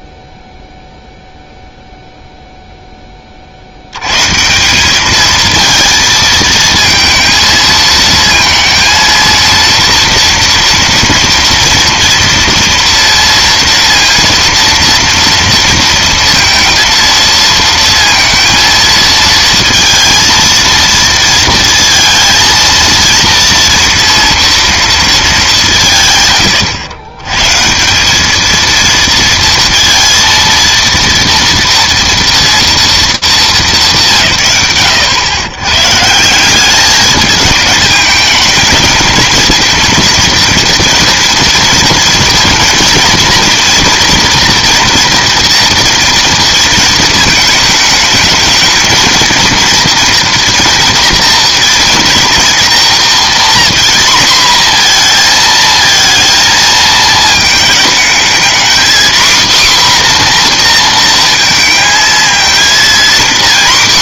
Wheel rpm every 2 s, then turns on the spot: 0, 0, 160, 220, 230, 230, 230, 230, 230, 230, 230, 230, 230, 110, 220, 230, 230, 120, 190, 220, 230, 230, 240, 230, 220, 240, 240, 240, 220, 240, 240, 230.
none